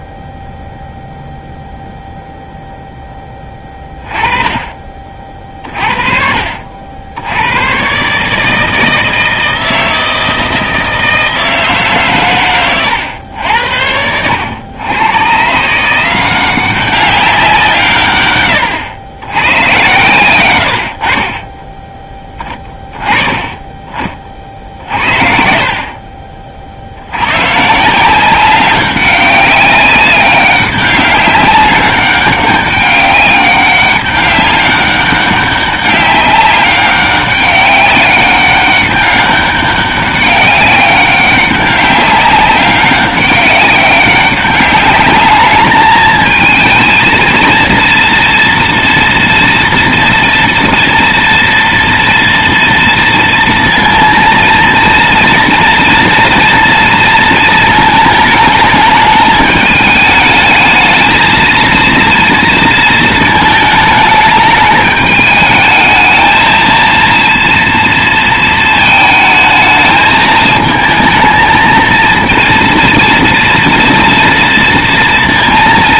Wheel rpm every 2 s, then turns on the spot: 0, 0, 20, 60, 160, 160, 120, 100, 190, 110, 100, 20, 50, 50, 190, 190, 200, 200, 190, 200, 200, 190, 200, 220, 230, 230, 230, 230, 230, 220, 210, 230, 210, 220, 220, 220, 230, 230.
none